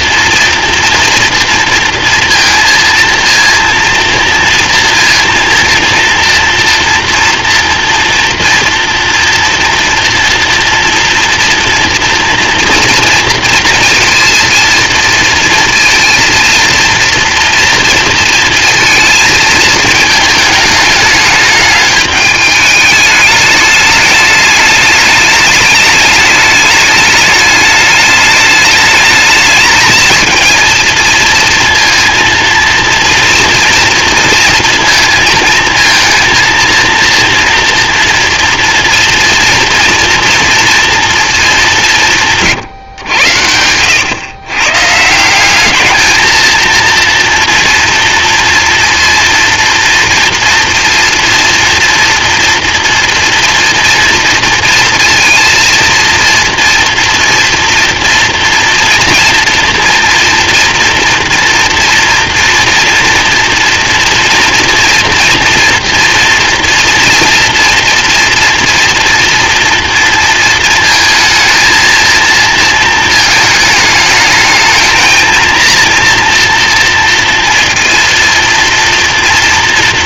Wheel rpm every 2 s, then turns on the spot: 230, 230, 230, 230, 230, 230, 230, 230, 230, 230, 210, 210, 210, 210, 210, 230, 240, 230, 230, 230, 230, 140, 130, 230, 230, 230, 230, 230, 230, 230, 240, 230, 230, 230, 230, 230, 230, 220, 230, 230.
42-44